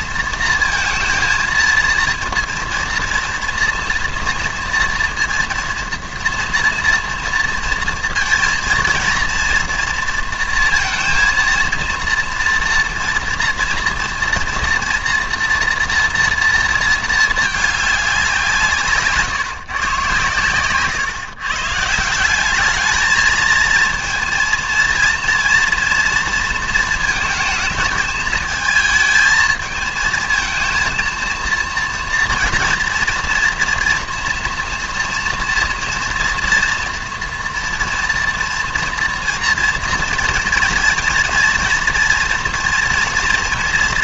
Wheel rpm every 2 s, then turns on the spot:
230, 230, 230, 230, 230, 230, 230, 230, 230, 170, 120, 200, 230, 230, 220, 230, 230, 230, 230, 230, 230, 230.
none